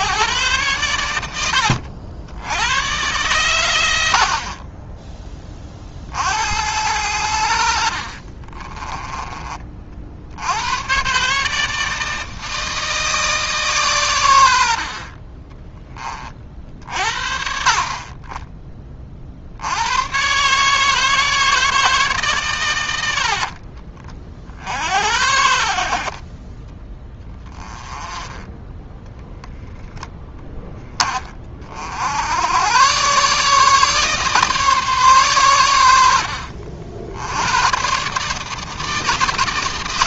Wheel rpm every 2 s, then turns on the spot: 130, 100, 30, 70, 30, 100, 160, 70, 50, 20, 140, 120, 60, 20, 10, 10, 90, 140, 60, 160.
8-10 28-30